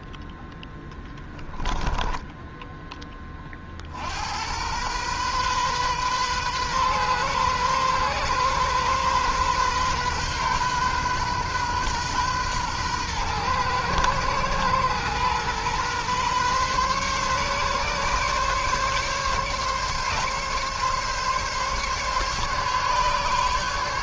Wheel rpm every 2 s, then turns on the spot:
10, 10, 90, 130, 130, 130, 120, 120, 130, 140, 140, 140.
0-4